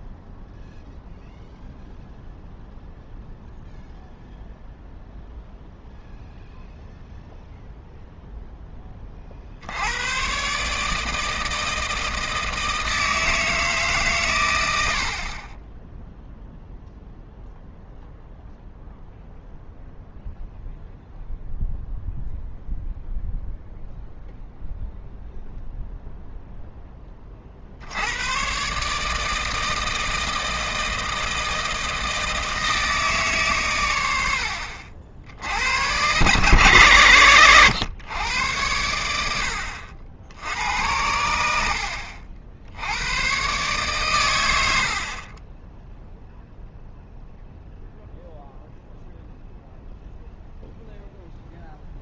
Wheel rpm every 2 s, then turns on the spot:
0, 0, 0, 0, 10, 150, 160, 80, 0, 0, 0, 0, 0, 0, 140, 160, 160, 60, 100, 100, 80, 80, 70, 0, 0, 0.
14-16